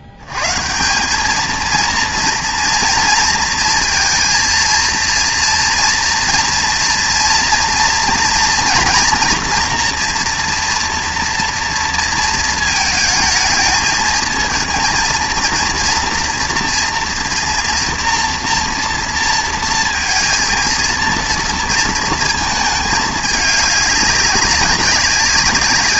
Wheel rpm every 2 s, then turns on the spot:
90, 230, 230, 230, 240, 240, 230, 220, 230, 230, 230, 230, 200.
none